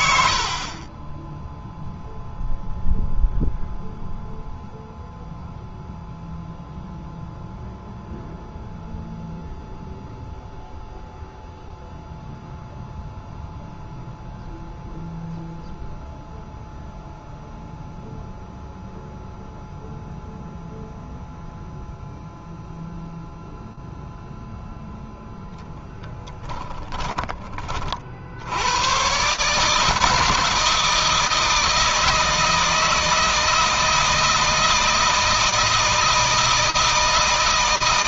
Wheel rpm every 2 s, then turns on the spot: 20, 0, 0, 0, 0, 0, 0, 0, 0, 0, 0, 0, 0, 20, 120, 160, 160, 160, 160.
none